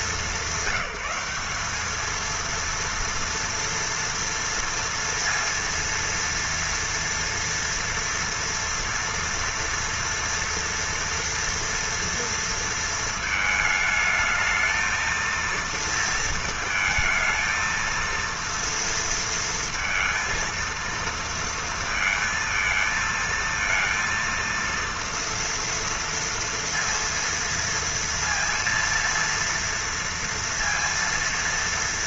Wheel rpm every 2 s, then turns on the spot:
190, 230, 230, 230, 230, 230, 230, 220, 230, 230, 230, 230, 230, 230, 230, 230.
none